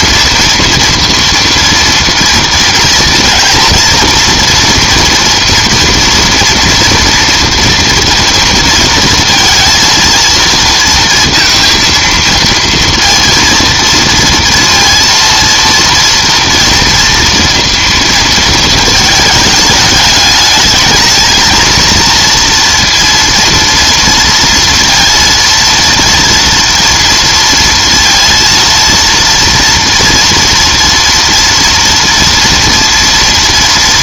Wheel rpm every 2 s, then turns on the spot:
230, 230, 230, 230, 230, 230, 230, 230, 230, 230, 210, 230, 230, 230, 230, 230, 230.
none